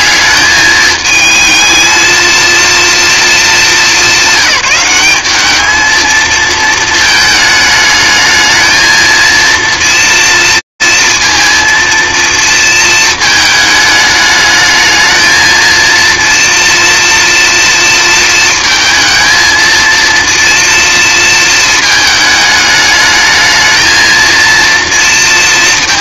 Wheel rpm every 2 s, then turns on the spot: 210, 230, 190, 220, 220, 230, 220, 210, 230, 220, 230, 210, 230.
none